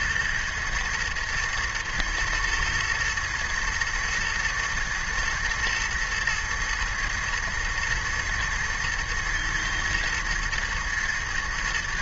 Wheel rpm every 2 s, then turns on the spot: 120, 120, 120, 110, 110, 110.
none